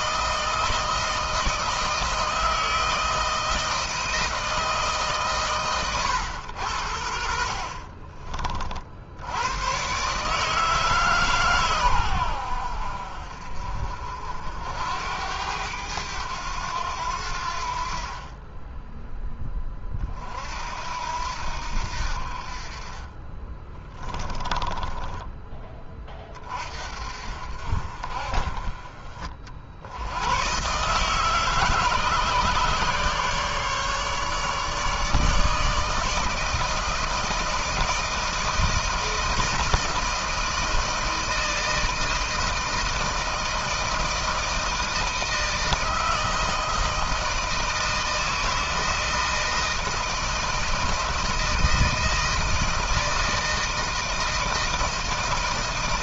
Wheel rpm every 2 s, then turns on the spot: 160, 160, 160, 100, 50, 150, 80, 70, 100, 10, 60, 40, 20, 40, 40, 120, 140, 150, 160, 160, 160, 160, 160, 160, 160, 160, 160, 160.
24-26